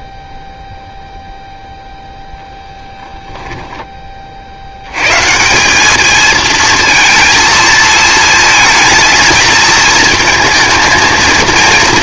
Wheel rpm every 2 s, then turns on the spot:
0, 0, 80, 220, 230, 230.
none